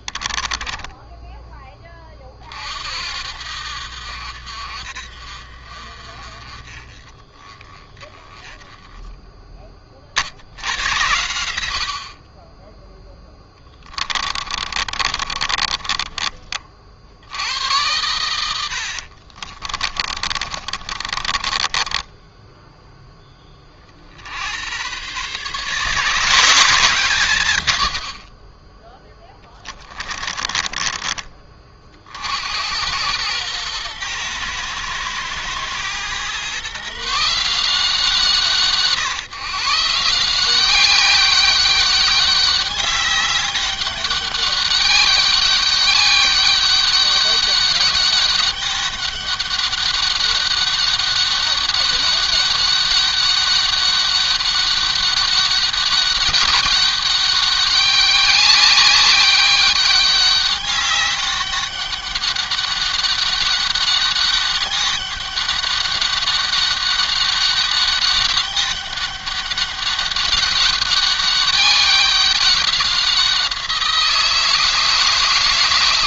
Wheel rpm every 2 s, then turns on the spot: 10, 50, 60, 30, 10, 70, 10, 30, 50, 80, 40, 10, 110, 170, 20, 30, 90, 110, 140, 150, 190, 200, 200, 200, 200, 200, 200, 200, 190, 200, 200, 200, 200, 200, 200, 200, 190, 160.
0-2 14-16 18-22 30-32